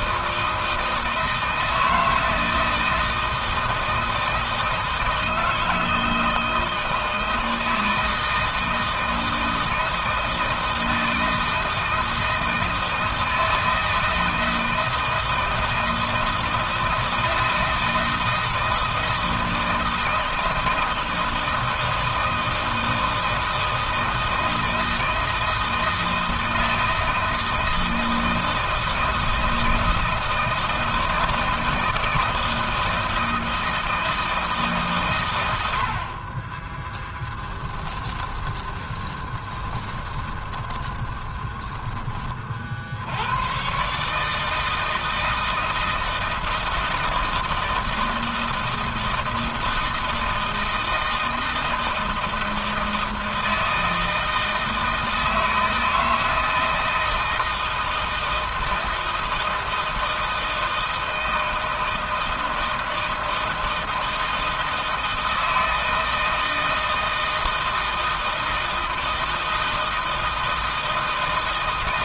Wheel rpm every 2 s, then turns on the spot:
160, 160, 160, 160, 160, 160, 160, 160, 160, 160, 160, 160, 160, 160, 160, 160, 160, 130, 10, 20, 20, 70, 160, 160, 160, 160, 160, 160, 160, 160, 160, 160, 160, 160, 160, 160.
36-42